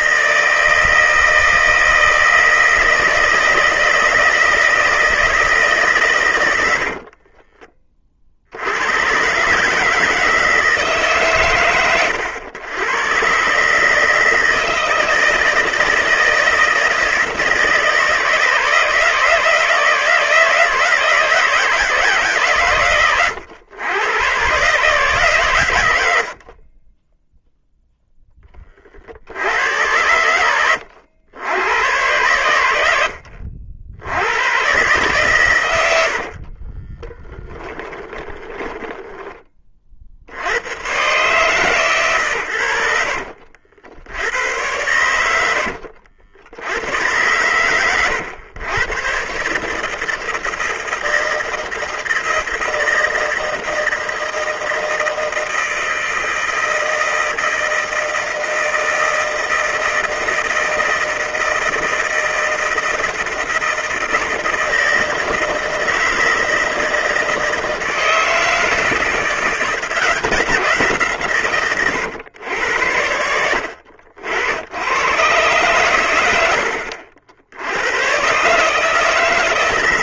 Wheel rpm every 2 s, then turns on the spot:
160, 160, 160, 80, 80, 150, 100, 160, 160, 150, 160, 130, 140, 30, 30, 80, 80, 120, 30, 10, 100, 90, 90, 90, 110, 160, 160, 160, 160, 160, 160, 160, 160, 160, 160, 170, 100, 100, 80, 150.
6-8 26-28 36-40